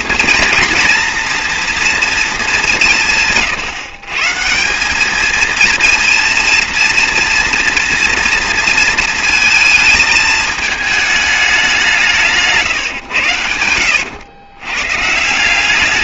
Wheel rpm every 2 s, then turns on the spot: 240, 200, 180, 230, 230, 220, 150, 110.
12-14